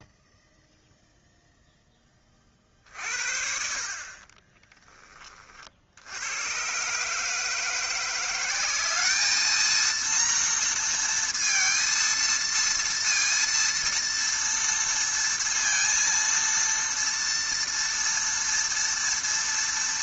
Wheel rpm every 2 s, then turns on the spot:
0, 50, 20, 120, 200, 240, 230, 230, 230, 230.
4-6